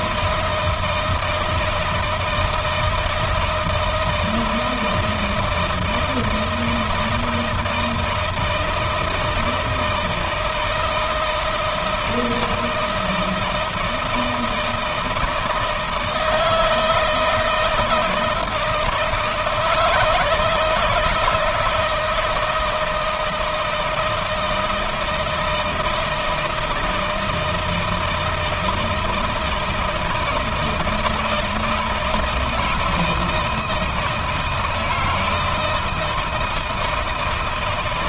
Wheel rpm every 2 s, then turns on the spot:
160, 160, 160, 160, 160, 160, 170, 160, 160, 160, 160, 160, 160, 160, 160, 160, 160, 160, 160.
none